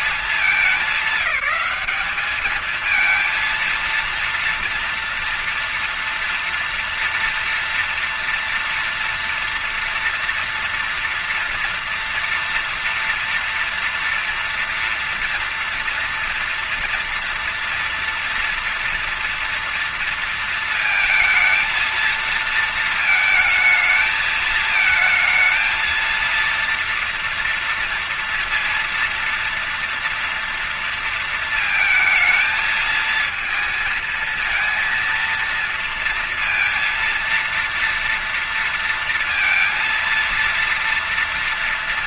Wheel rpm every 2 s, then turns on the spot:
210, 220, 230, 230, 240, 240, 230, 240, 230, 230, 230, 220, 220, 230, 230, 230, 220, 230, 230, 230, 230.
none